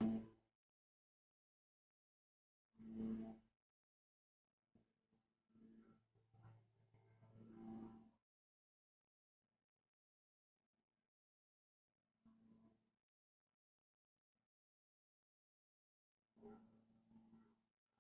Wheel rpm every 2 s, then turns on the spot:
0, 0, 0, 0, 0, 0, 0, 0, 0.
none